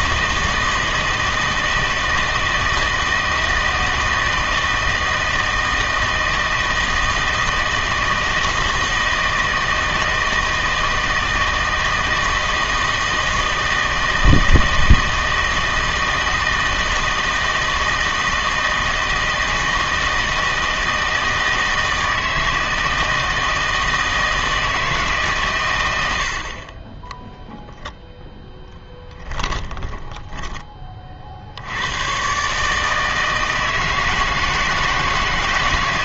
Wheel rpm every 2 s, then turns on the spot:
160, 160, 160, 160, 160, 160, 160, 160, 160, 160, 160, 160, 160, 40, 0, 20, 140, 160.
none